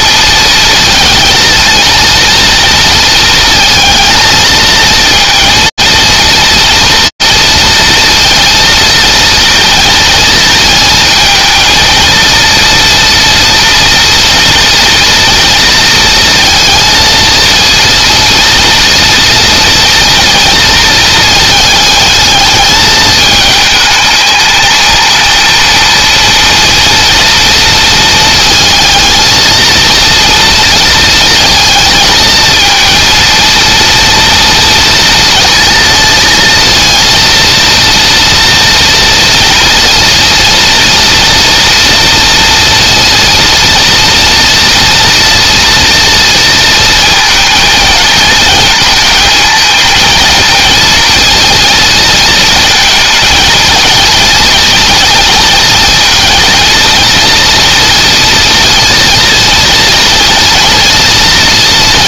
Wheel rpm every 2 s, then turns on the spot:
230, 230, 230, 230, 230, 230, 230, 230, 230, 230, 230, 220, 220, 230, 220, 230, 230, 230, 230, 230, 230, 230, 230, 230, 220, 230, 220, 230, 230, 230, 230.
none